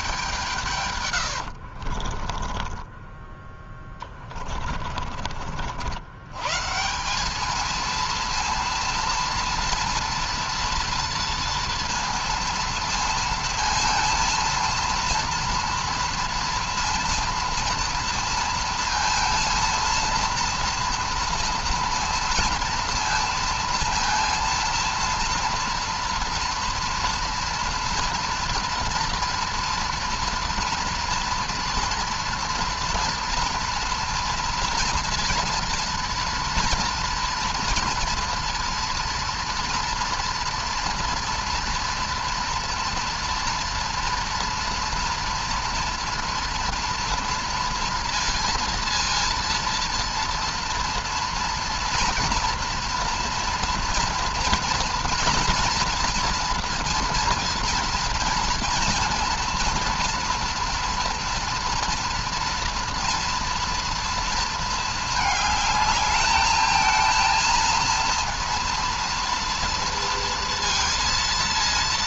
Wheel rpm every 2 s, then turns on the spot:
160, 20, 30, 130, 230, 230, 230, 230, 230, 230, 230, 230, 230, 230, 230, 230, 230, 230, 230, 230, 230, 240, 240, 230, 230, 230, 240, 230, 230, 230, 230, 230, 230, 220, 230, 230.
2-6